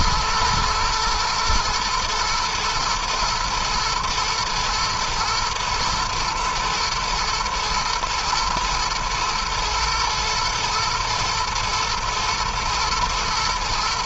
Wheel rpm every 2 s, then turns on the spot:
120, 110, 120, 120, 120, 110, 110.
none